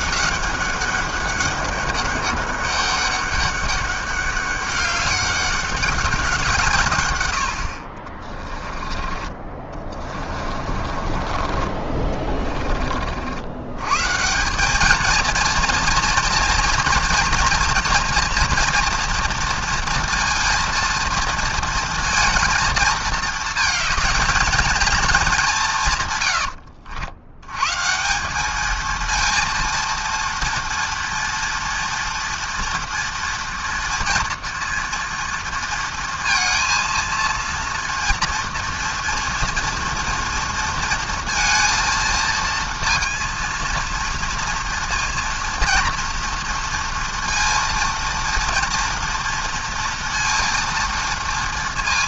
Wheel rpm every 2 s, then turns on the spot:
200, 200, 200, 140, 20, 30, 40, 200, 230, 240, 230, 230, 230, 90, 220, 230, 230, 230, 230, 230, 230, 230, 230, 230, 230, 230.
8-12 26-28